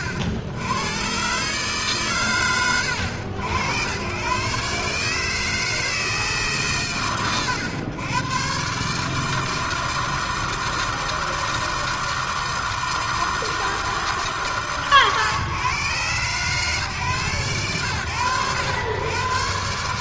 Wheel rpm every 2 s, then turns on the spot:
100, 70, 130, 110, 130, 160, 160, 130, 140, 90.
none